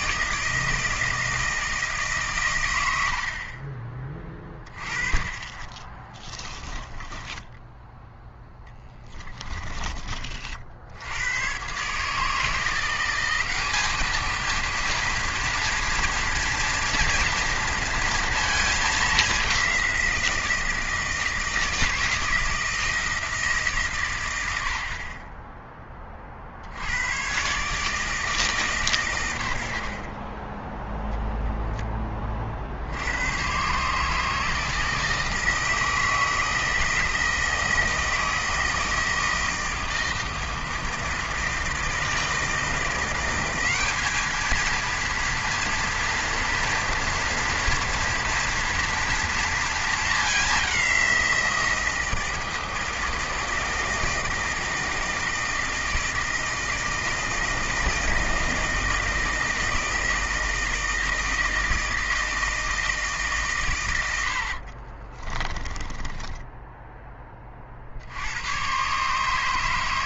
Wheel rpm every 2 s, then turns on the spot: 160, 100, 30, 20, 10, 60, 170, 230, 230, 220, 170, 160, 70, 70, 130, 10, 60, 160, 160, 160, 160, 160, 220, 230, 230, 200, 160, 160, 160, 160, 160, 160, 50, 10, 110.
6-8 30-32 64-68